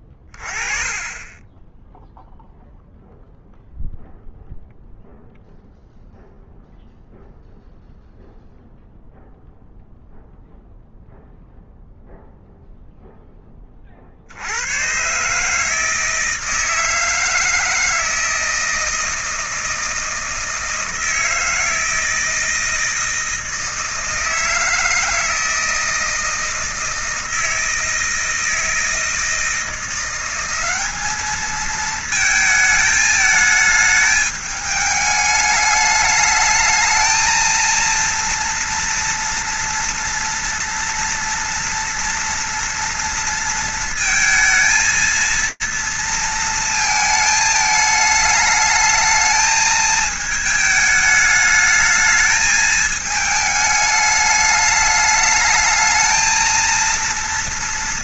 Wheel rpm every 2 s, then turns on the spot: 20, 0, 0, 0, 0, 0, 0, 130, 160, 160, 160, 160, 160, 160, 160, 210, 220, 210, 220, 230, 230, 230, 230, 220, 220, 210, 220, 210, 230.
none